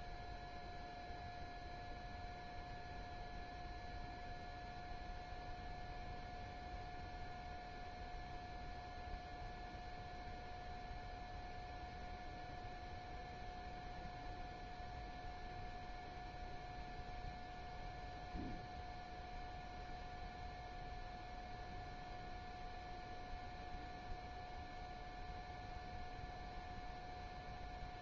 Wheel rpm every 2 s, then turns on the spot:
0, 0, 0, 0, 0, 0, 0, 0, 0, 0, 0, 0, 0, 0.
none